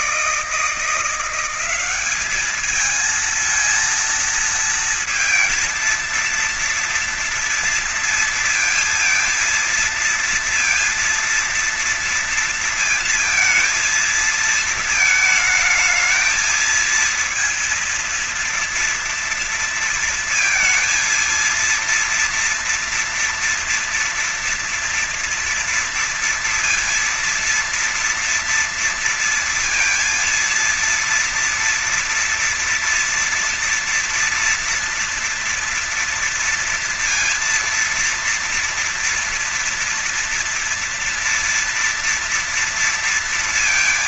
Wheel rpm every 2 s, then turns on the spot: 160, 210, 230, 230, 230, 230, 230, 220, 220, 230, 230, 230, 230, 230, 230, 230, 230, 230, 230, 230, 230, 230.
none